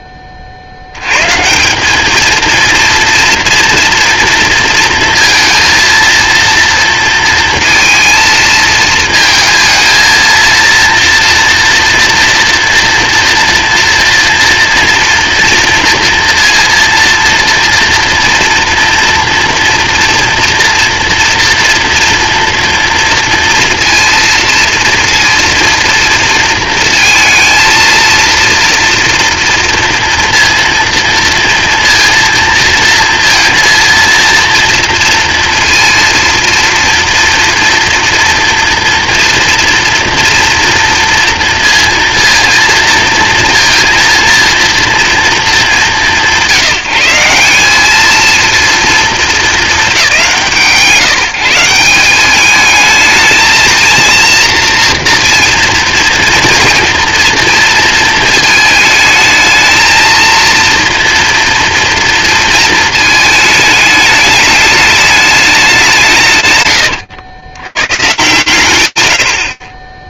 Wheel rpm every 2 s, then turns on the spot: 50, 230, 230, 230, 220, 230, 230, 230, 230, 230, 230, 230, 230, 230, 230, 230, 230, 230, 230, 230, 240, 230, 230, 170, 220, 140, 220, 230, 230, 220, 230, 220, 210, 120, 100.
none